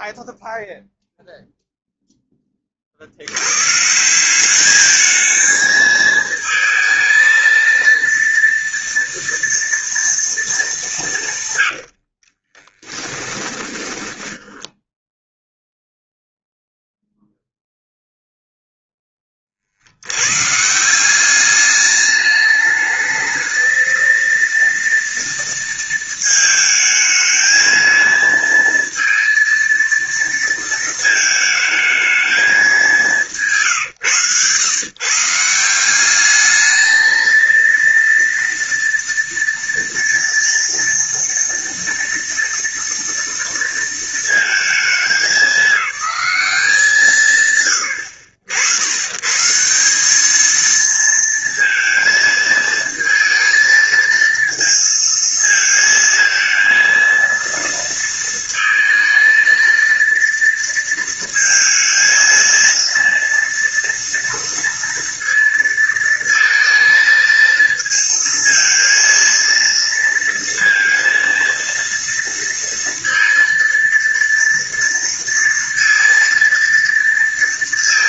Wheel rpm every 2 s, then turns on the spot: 0, 20, 200, 220, 230, 210, 30, 10, 0, 0, 140, 210, 230, 220, 230, 230, 200, 120, 210, 230, 230, 230, 220, 190, 70, 220, 220, 230, 230, 230, 230, 230, 230, 230, 230, 230, 230, 230, 230.
12-16